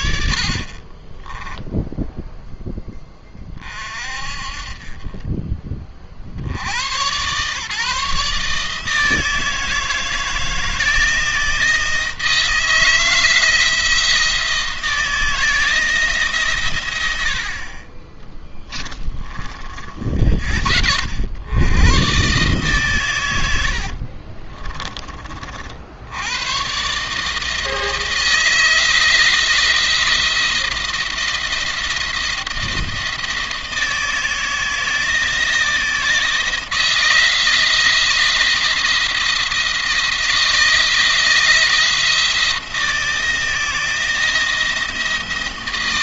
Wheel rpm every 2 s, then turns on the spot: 50, 10, 40, 90, 160, 160, 160, 160, 100, 10, 60, 140, 30, 130, 160, 170, 170, 160, 160, 170, 160, 170, 170.
18-20 24-26